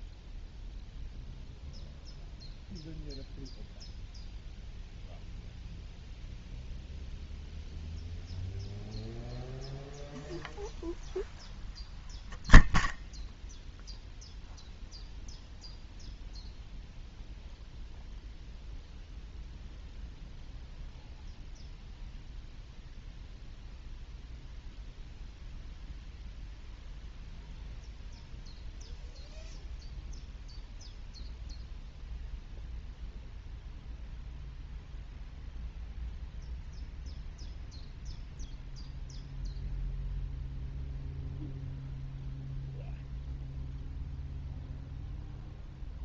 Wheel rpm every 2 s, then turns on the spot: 0, 0, 0, 0, 0, 0, 0, 0, 0, 0, 0, 0, 0, 0, 0, 0, 0, 0, 0, 0, 0, 0, 0.
none